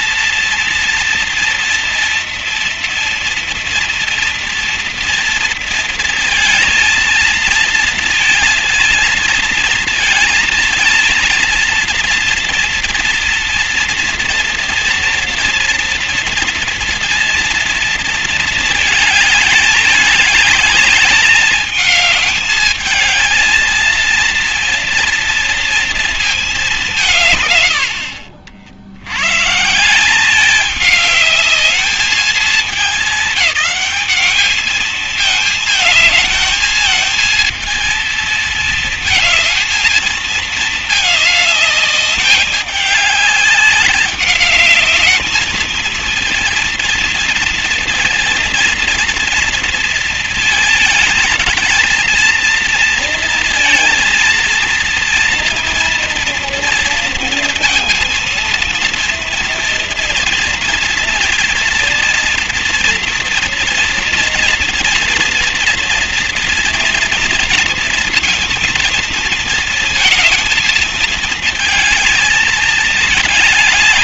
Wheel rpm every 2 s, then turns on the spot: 230, 230, 230, 230, 230, 230, 230, 230, 230, 230, 210, 210, 230, 230, 70, 180, 220, 210, 220, 230, 220, 210, 200, 220, 230, 230, 220, 230, 230, 230, 230, 230, 230, 230, 230, 230, 220.
none